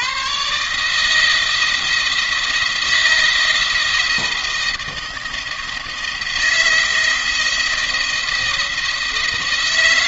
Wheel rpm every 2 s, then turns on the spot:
140, 170, 170, 160, 160.
none